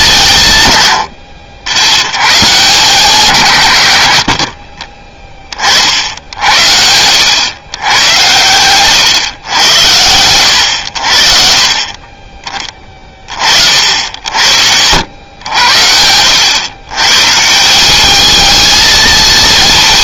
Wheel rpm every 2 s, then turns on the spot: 160, 120, 70, 70, 120, 90, 30, 70, 110, 220.
14-16